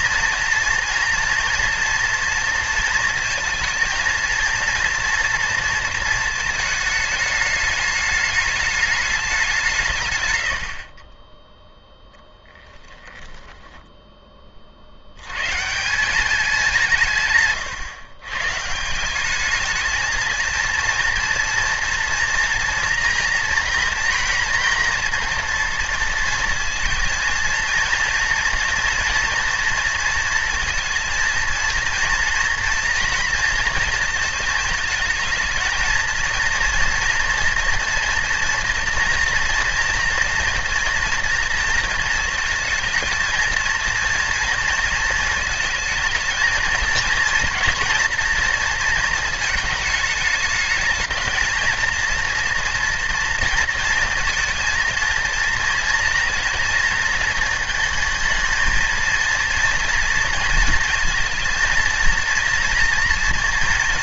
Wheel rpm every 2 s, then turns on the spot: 230, 230, 230, 220, 210, 40, 10, 60, 170, 160, 230, 230, 230, 230, 230, 230, 230, 220, 230, 230, 240, 230, 230, 230, 230, 220, 230, 230, 230, 230, 230, 230.
12-14